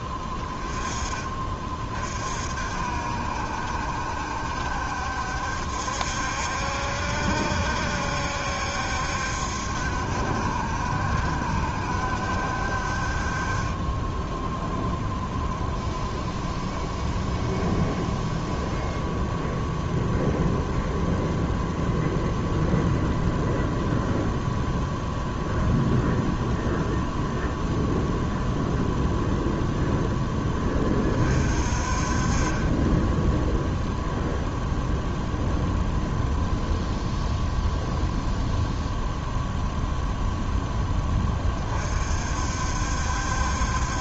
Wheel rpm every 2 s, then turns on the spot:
20, 50, 70, 70, 70, 70, 60, 0, 0, 0, 0, 0, 0, 0, 0, 20, 20, 0, 0, 0, 0, 60.
none